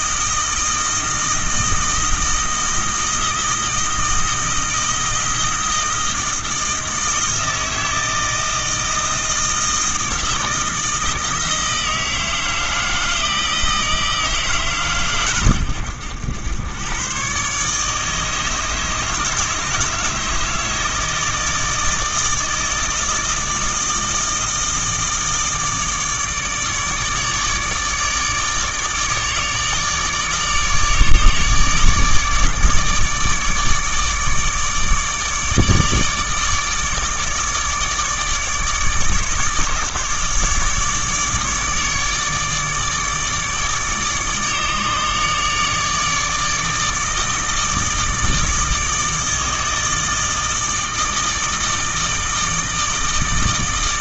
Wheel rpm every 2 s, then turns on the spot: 160, 160, 160, 160, 160, 160, 160, 140, 110, 160, 160, 160, 160, 150, 150, 150, 150, 150, 150, 150, 150, 150, 150, 160, 160, 160, 160.
none